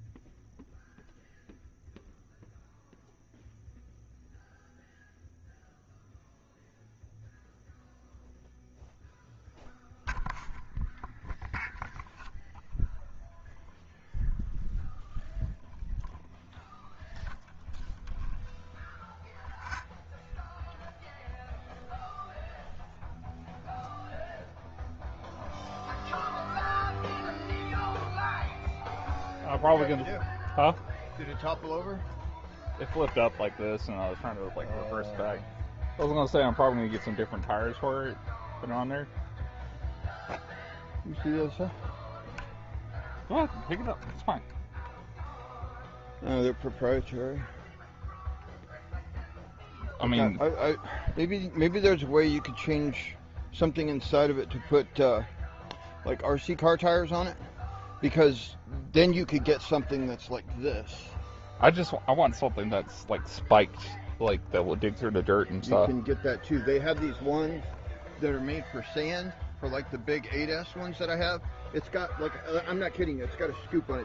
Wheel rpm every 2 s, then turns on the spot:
0, 0, 0, 0, 0, 0, 0, 0, 0, 0, 0, 0, 0, 0, 0, 0, 0, 0, 0, 0, 0, 0, 0, 0, 0, 0, 0, 0, 0, 0, 0, 0, 0, 0, 0, 0, 0.
none